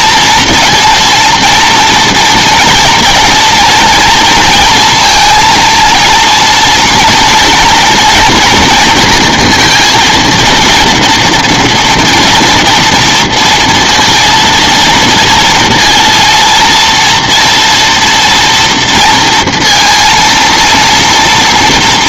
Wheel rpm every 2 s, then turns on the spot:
230, 240, 230, 230, 230, 230, 230, 230, 230, 240, 230.
none